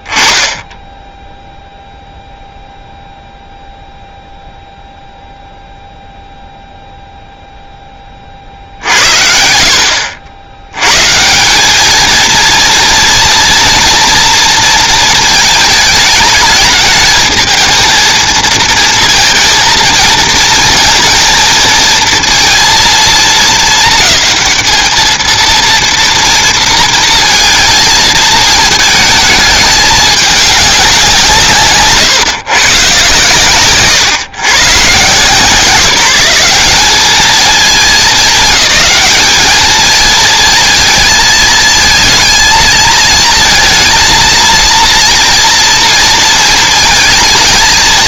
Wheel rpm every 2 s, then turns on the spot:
10, 0, 0, 0, 50, 90, 230, 230, 210, 220, 230, 230, 220, 230, 220, 200, 140, 120, 190, 210, 230, 220, 230, 220.
none